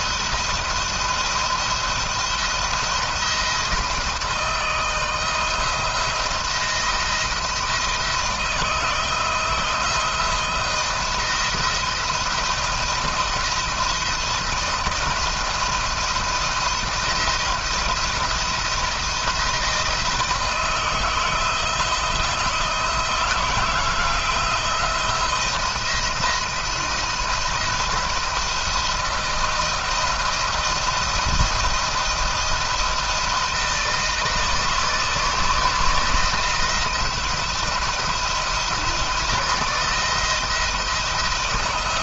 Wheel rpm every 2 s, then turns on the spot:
170, 170, 160, 170, 160, 160, 160, 170, 170, 170, 160, 160, 160, 170, 170, 160, 170, 160, 160, 160, 170.
none